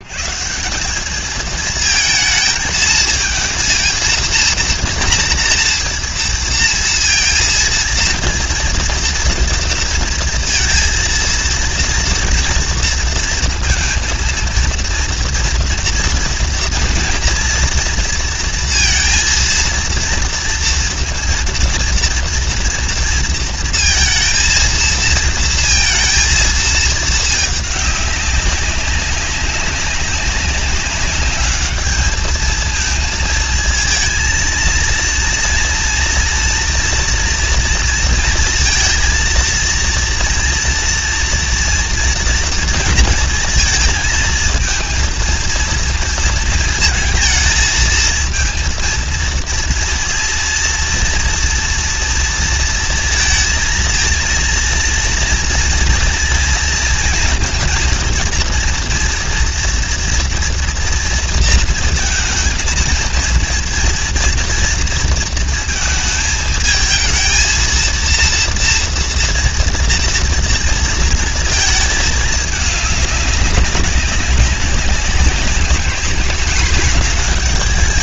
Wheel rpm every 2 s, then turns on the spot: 140, 220, 230, 230, 230, 230, 230, 230, 230, 230, 230, 230, 230, 230, 190, 200, 220, 220, 240, 230, 230, 230, 220, 230, 230, 230, 230, 230, 230, 230, 230, 230, 230, 220, 230, 230, 220, 200, 210.
none